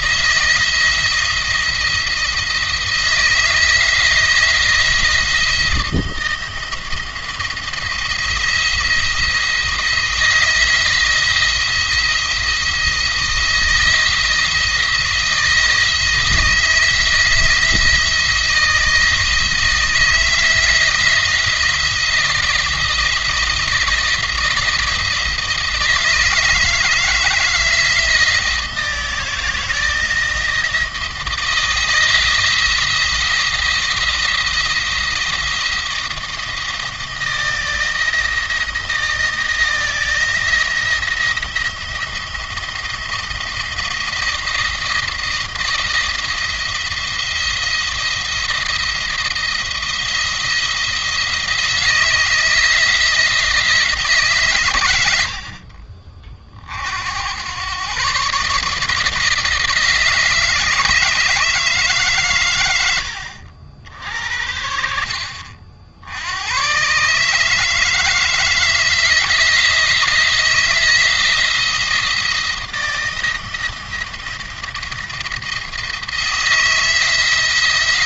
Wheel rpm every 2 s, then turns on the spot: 170, 160, 170, 170, 170, 170, 160, 160, 160, 160, 170, 170, 170, 160, 160, 170, 170, 170, 160, 170, 170, 170, 170, 170, 170, 160, 160, 110, 60, 150, 160, 100, 60, 130, 170, 170, 170, 170, 160.
62-66